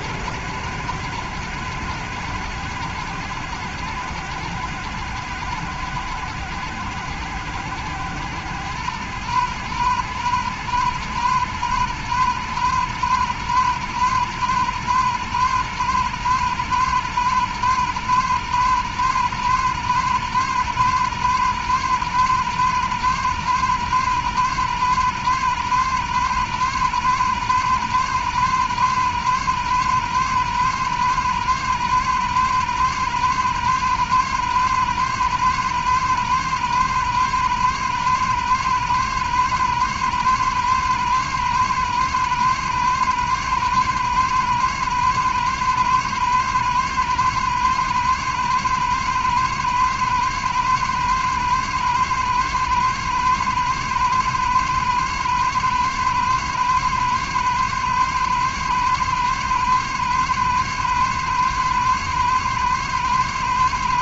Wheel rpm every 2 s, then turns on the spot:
100, 100, 100, 90, 100, 100, 100, 100, 100, 110, 110, 110, 110, 110, 110, 110, 100, 110, 110, 110, 110, 110, 110, 110, 110, 110, 110, 110, 110, 110, 110, 110.
none